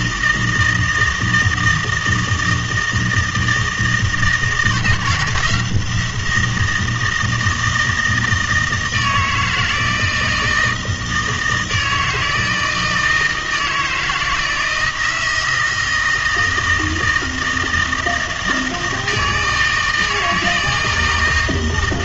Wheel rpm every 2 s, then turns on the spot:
160, 160, 160, 170, 160, 160, 160, 160, 160, 160, 160.
none